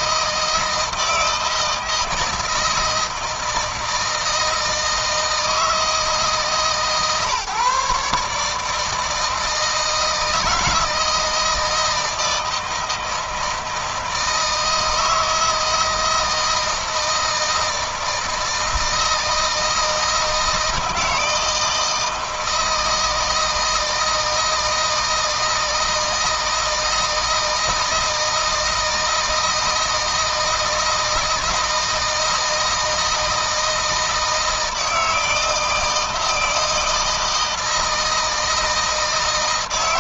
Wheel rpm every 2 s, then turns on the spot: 160, 160, 160, 150, 160, 160, 160, 160, 160, 160, 160, 160, 160, 160, 160, 160, 160, 160, 160, 160.
none